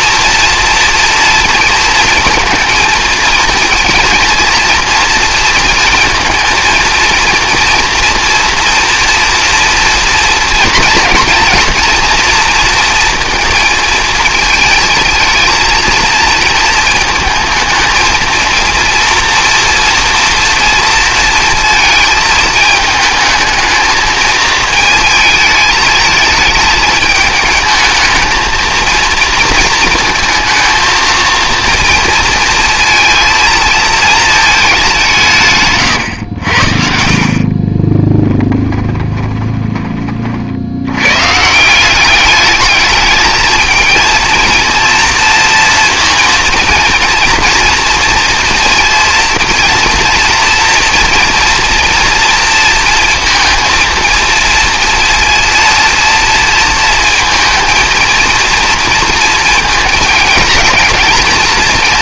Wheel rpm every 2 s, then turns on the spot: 230, 230, 230, 230, 240, 230, 230, 220, 220, 230, 230, 220, 220, 210, 230, 230, 230, 210, 70, 20, 100, 210, 230, 230, 230, 230, 230, 230, 230, 230, 230.
38-40